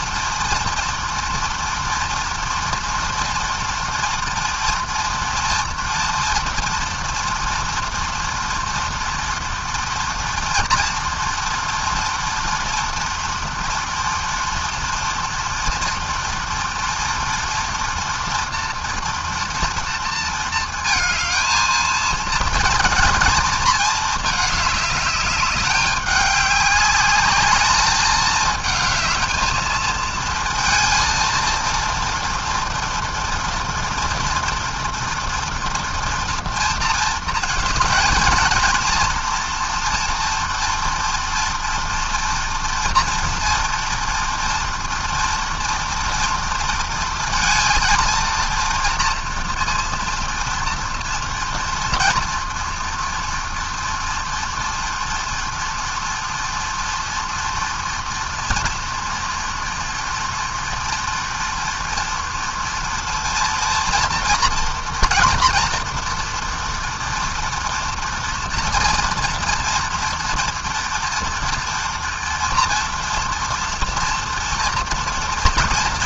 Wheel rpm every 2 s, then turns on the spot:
230, 230, 230, 230, 240, 230, 230, 230, 230, 230, 220, 220, 210, 210, 220, 230, 230, 230, 230, 230, 240, 230, 230, 230, 230, 230, 230, 240, 230, 230, 230, 230, 230, 240, 230, 230, 230, 230.
none